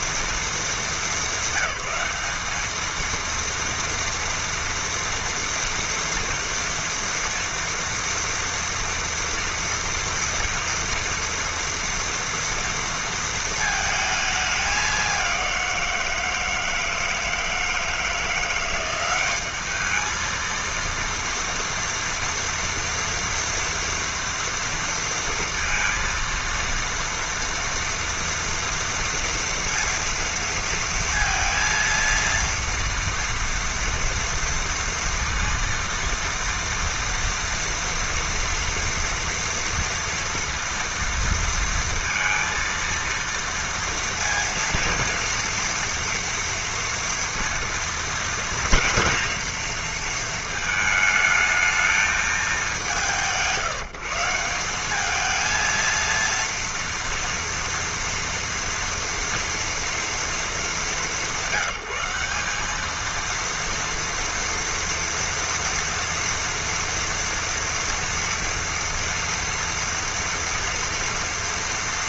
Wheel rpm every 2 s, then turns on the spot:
200, 230, 230, 230, 230, 230, 230, 200, 160, 190, 230, 230, 230, 230, 230, 230, 230, 230, 230, 230, 230, 230, 230, 230, 230, 220, 130, 220, 230, 230, 180, 230, 230, 230, 230, 230.
none